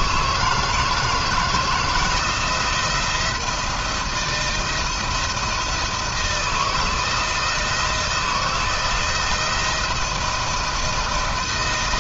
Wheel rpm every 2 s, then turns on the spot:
170, 170, 170, 160, 160, 170.
none